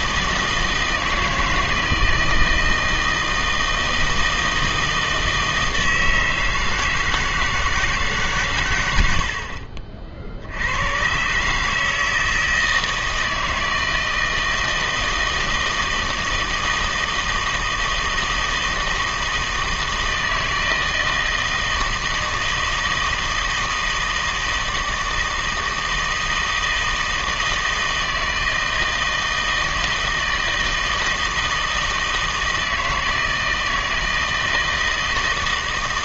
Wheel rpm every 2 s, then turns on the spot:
160, 160, 160, 160, 110, 80, 160, 160, 160, 160, 160, 160, 160, 160, 160, 160, 160, 160.
none